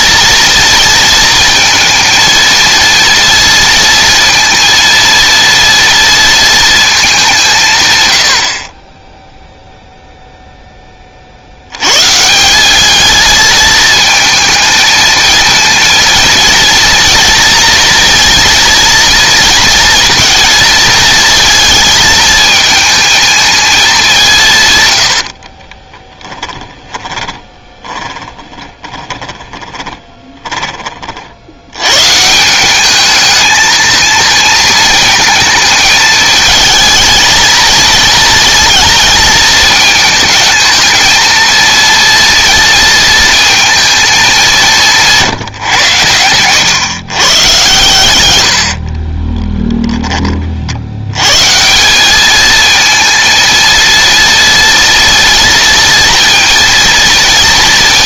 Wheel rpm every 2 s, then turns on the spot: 230, 230, 230, 230, 40, 10, 190, 220, 230, 230, 230, 220, 140, 10, 20, 20, 180, 230, 220, 220, 220, 230, 180, 110, 80, 40, 220, 230, 230.
26-30 48-50